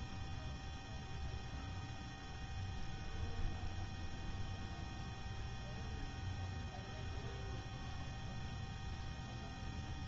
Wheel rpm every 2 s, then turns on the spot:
0, 0, 0, 0, 0.
none